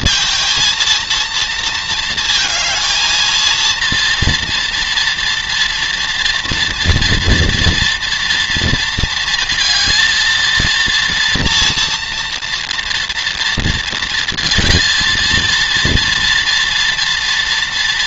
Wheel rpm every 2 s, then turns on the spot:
230, 220, 230, 230, 230, 230, 230, 230, 230.
none